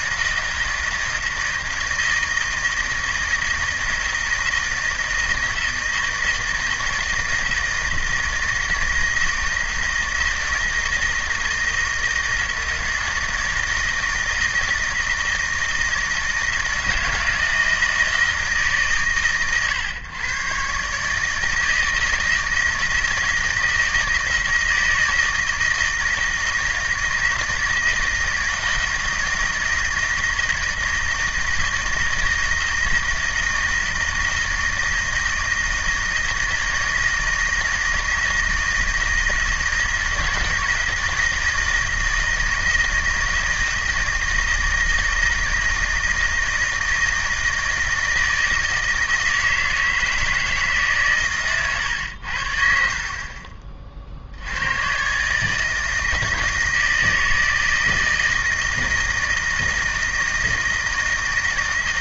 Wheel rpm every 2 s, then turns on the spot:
160, 160, 160, 160, 160, 160, 160, 160, 160, 130, 140, 160, 160, 160, 160, 160, 160, 160, 160, 160, 160, 160, 160, 160, 160, 140, 50, 110, 160, 160, 160.
none